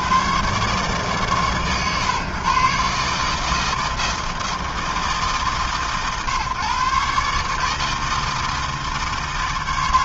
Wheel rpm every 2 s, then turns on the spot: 70, 130, 160, 140, 150.
none